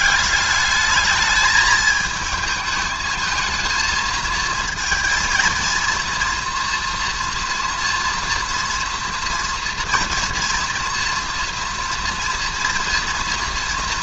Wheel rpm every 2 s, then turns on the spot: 210, 220, 230, 230, 230, 230, 230.
none